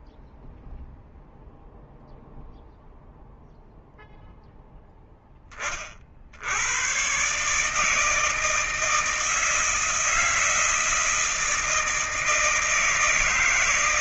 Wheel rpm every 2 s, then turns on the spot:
0, 0, 0, 80, 160, 160, 160.
none